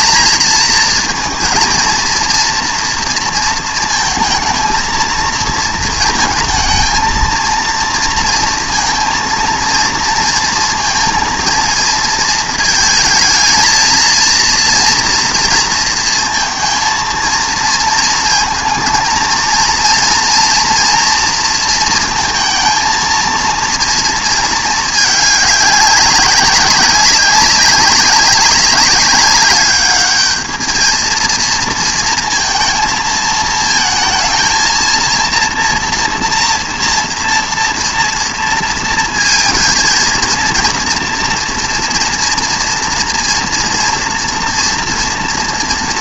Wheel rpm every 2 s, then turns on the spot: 230, 230, 230, 230, 230, 230, 220, 230, 230, 230, 230, 230, 220, 200, 190, 220, 230, 230, 230, 230, 240, 230, 230.
none